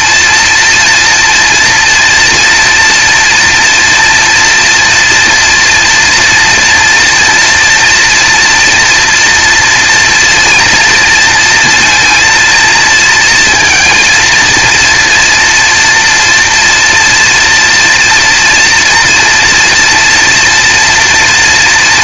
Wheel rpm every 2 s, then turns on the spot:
240, 230, 230, 230, 240, 230, 220, 230, 230, 240, 230.
none